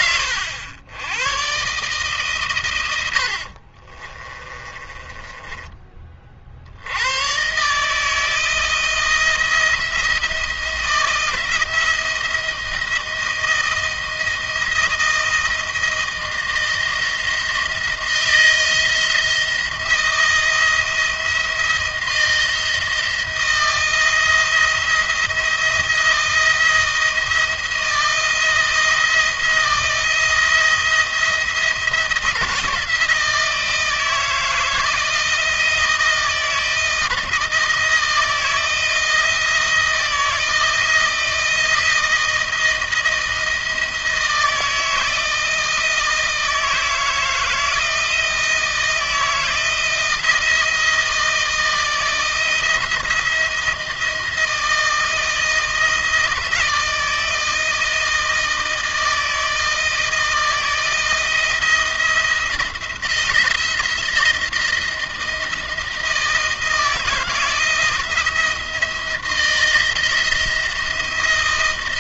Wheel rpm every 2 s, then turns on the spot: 100, 100, 20, 80, 160, 170, 160, 170, 160, 160, 170, 160, 170, 170, 160, 160, 160, 160, 160, 160, 160, 170, 160, 160, 160, 160, 170, 160, 160, 160, 160, 170, 170, 170, 170, 170.
2-6